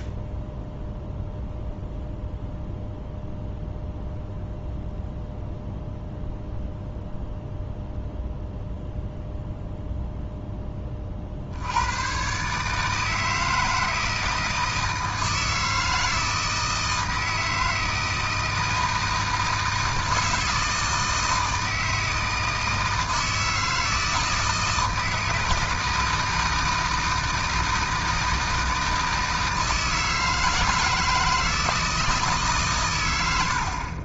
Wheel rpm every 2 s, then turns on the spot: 0, 0, 0, 0, 0, 20, 150, 160, 160, 160, 160, 160, 160, 160, 160, 160, 120.
none